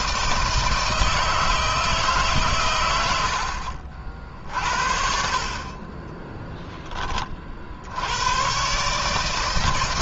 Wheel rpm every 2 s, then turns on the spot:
160, 100, 60, 20, 140.
none